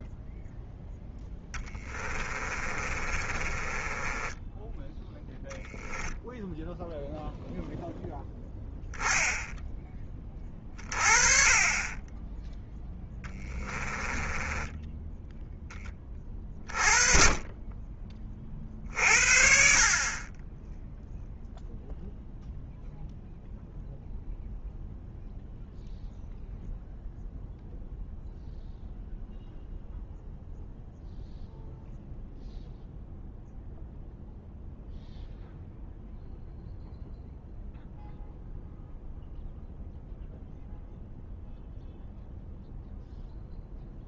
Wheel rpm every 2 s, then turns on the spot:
0, 30, 10, 10, 10, 30, 10, 10, 30, 50, 10, 0, 0, 0, 0, 0, 0, 0, 0, 0, 0, 0.
2-4 14-16